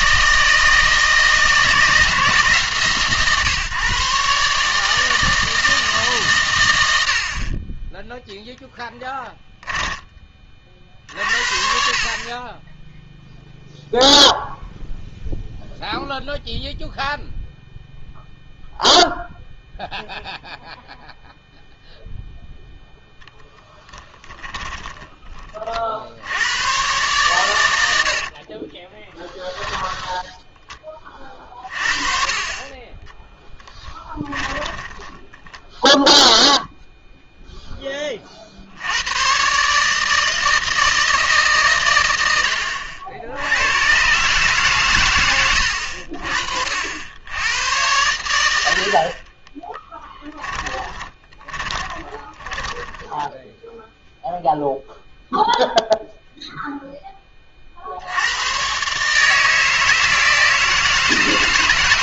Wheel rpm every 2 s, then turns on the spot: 160, 150, 150, 100, 10, 50, 10, 0, 0, 0, 0, 0, 20, 110, 30, 20, 30, 20, 0, 70, 160, 80, 140, 50, 80, 20, 10, 0, 0, 120, 160.
8-10 24-26 28-30 34-36 50-54